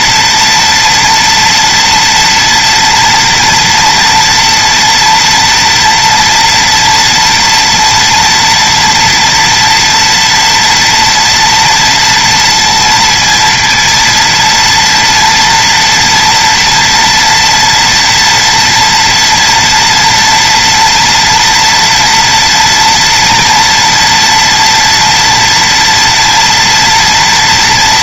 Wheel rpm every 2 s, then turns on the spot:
230, 230, 230, 230, 230, 230, 230, 230, 230, 230, 230, 240, 230, 230.
none